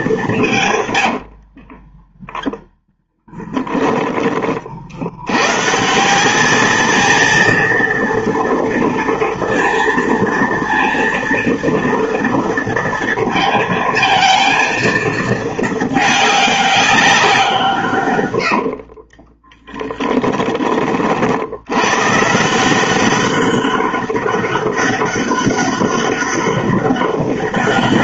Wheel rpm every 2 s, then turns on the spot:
130, 0, 60, 220, 230, 230, 230, 230, 200, 70, 30, 190, 200, 200.
0-2 18-20